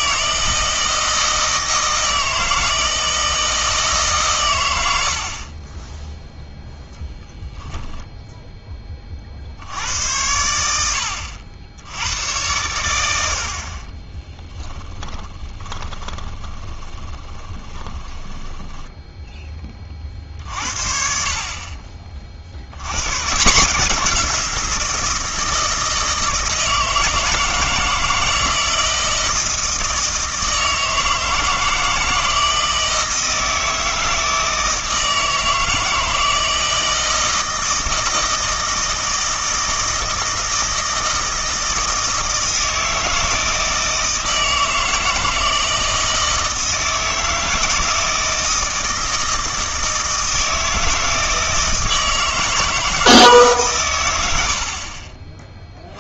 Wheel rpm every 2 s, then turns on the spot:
160, 160, 110, 0, 10, 90, 100, 10, 20, 10, 50, 60, 170, 160, 160, 160, 160, 160, 160, 160, 160, 160, 160, 160, 160, 160, 160, 60.
14-20